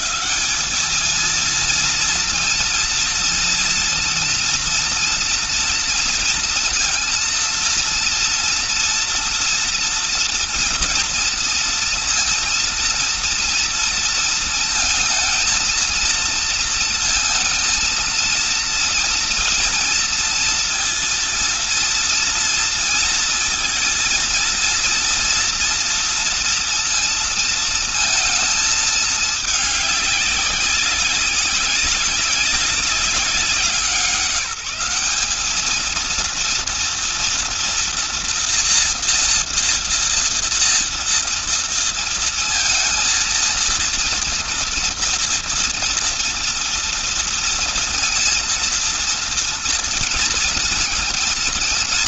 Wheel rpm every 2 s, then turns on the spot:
210, 230, 230, 230, 230, 230, 230, 220, 230, 230, 230, 230, 230, 230, 220, 200, 200, 190, 230, 230, 230, 230, 230, 230, 230, 230.
none